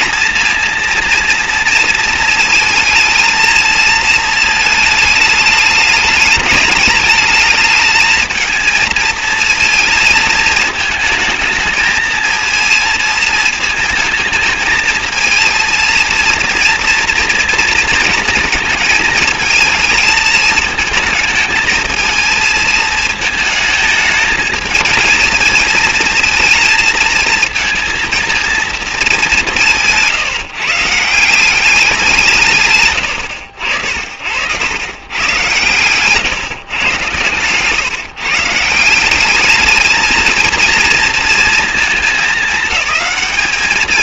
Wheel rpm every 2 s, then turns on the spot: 230, 220, 220, 210, 220, 220, 220, 220, 230, 220, 220, 220, 220, 230, 220, 160, 90, 110, 120, 180, 230, 210.
32-34